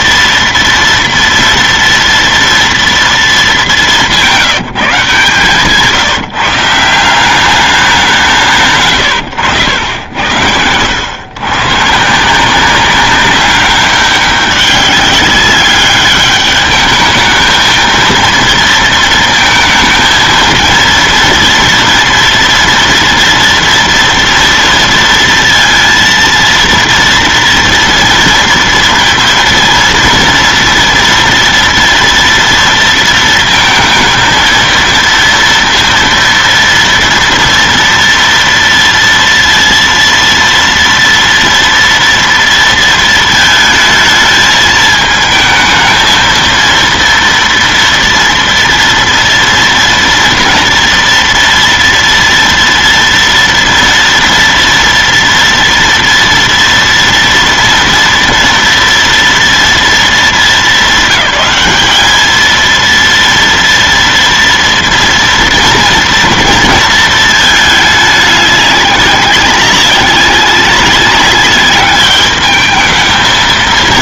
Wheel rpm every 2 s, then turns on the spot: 230, 230, 170, 170, 140, 80, 190, 190, 210, 230, 230, 230, 230, 230, 230, 230, 230, 230, 230, 230, 230, 230, 220, 230, 230, 230, 230, 240, 230, 230, 210, 230, 230, 230, 200, 200, 220.
none